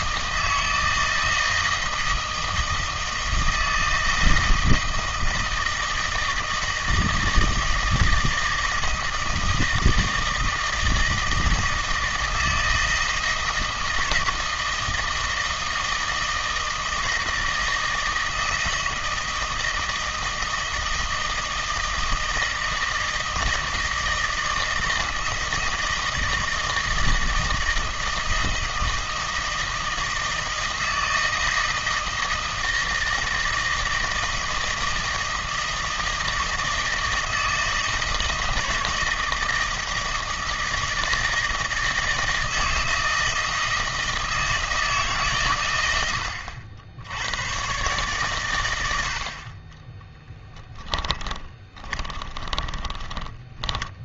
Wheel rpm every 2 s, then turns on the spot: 160, 160, 160, 160, 160, 160, 160, 160, 160, 160, 160, 170, 160, 160, 160, 160, 160, 160, 160, 160, 160, 160, 160, 80, 110, 10, 30.
50-54